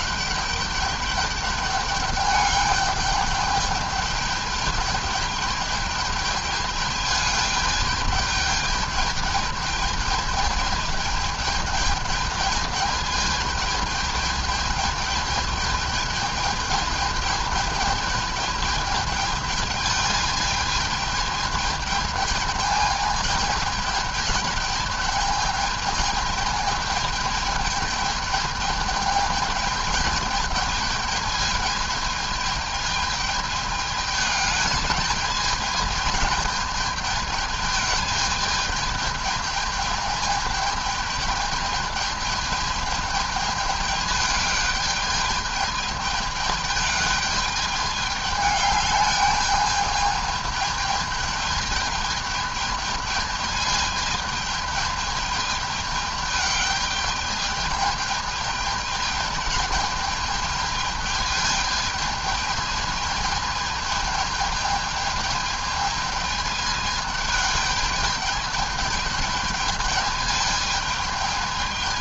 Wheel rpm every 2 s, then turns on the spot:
210, 210, 210, 210, 210, 210, 210, 210, 220, 220, 220, 210, 210, 220, 210, 210, 210, 210, 210, 210, 220, 210, 210, 210, 210, 220, 210, 210, 210, 210, 220, 210, 210, 210, 210, 210.
none